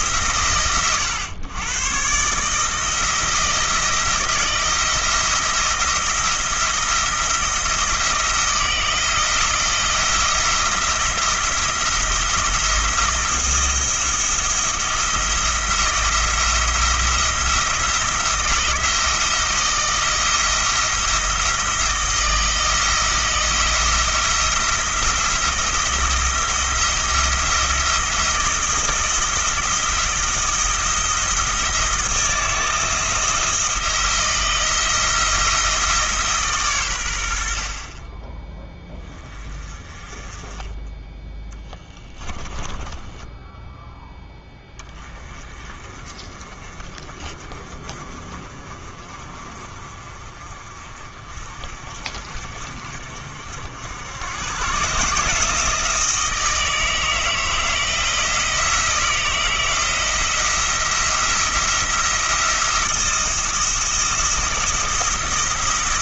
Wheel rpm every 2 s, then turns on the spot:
120, 160, 170, 170, 160, 170, 170, 170, 170, 170, 160, 170, 160, 170, 170, 170, 170, 170, 120, 20, 10, 20, 20, 40, 40, 40, 60, 140, 160, 170, 170, 170, 170.
42-44